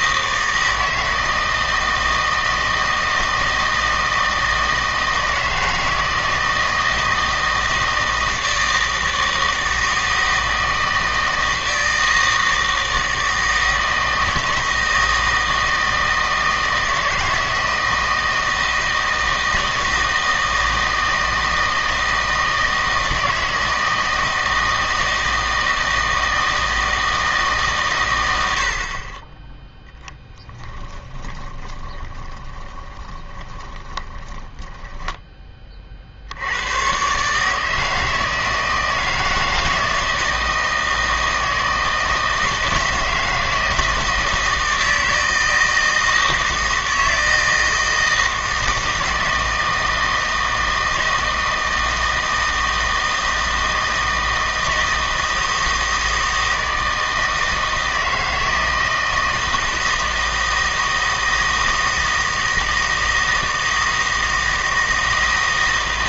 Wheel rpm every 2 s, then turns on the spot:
160, 160, 160, 160, 160, 160, 160, 160, 160, 160, 160, 160, 160, 160, 60, 10, 20, 10, 100, 160, 160, 160, 160, 160, 160, 160, 160, 160, 160, 160, 160, 160, 160.
30-36